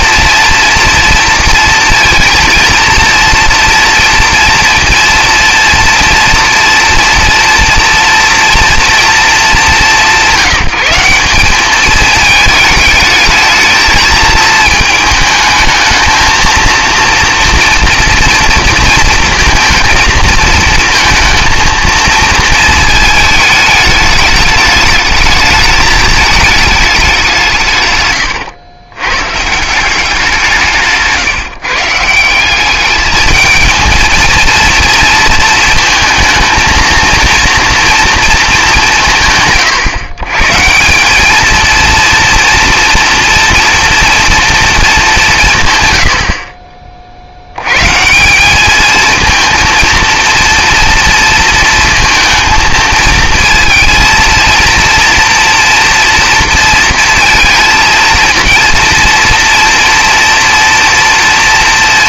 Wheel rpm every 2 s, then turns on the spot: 230, 230, 230, 230, 230, 170, 220, 220, 230, 230, 230, 220, 210, 220, 100, 170, 190, 230, 230, 210, 150, 230, 230, 40, 200, 230, 230, 230, 230, 230, 230.
none